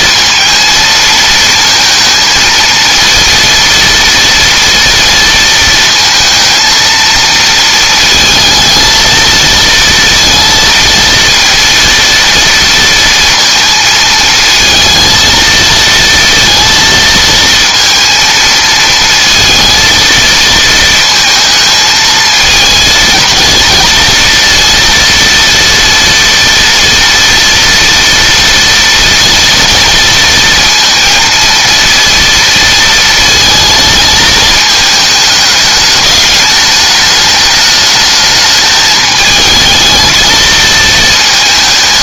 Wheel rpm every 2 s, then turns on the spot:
230, 230, 230, 230, 220, 230, 230, 230, 230, 220, 230, 230, 230, 230, 230, 230, 230, 220, 210, 210, 220.
none